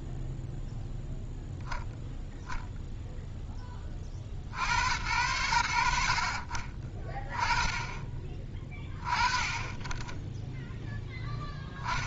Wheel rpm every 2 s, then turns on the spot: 0, 10, 80, 20, 50, 0.
none